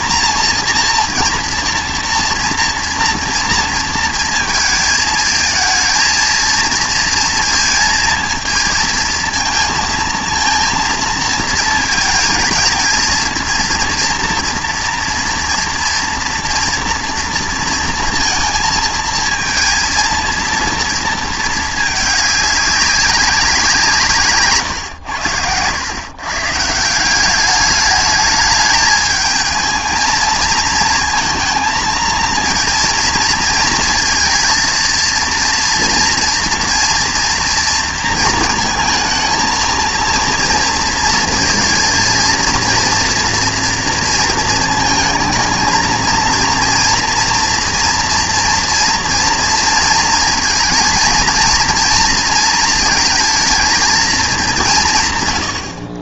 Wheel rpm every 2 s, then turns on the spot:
230, 230, 220, 230, 230, 230, 220, 230, 240, 230, 230, 200, 140, 140, 210, 220, 230, 230, 230, 230, 230, 230, 230, 230, 230, 230, 230, 180.
none